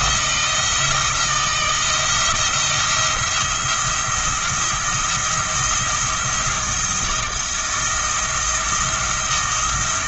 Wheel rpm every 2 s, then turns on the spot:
160, 170, 170, 170, 170.
none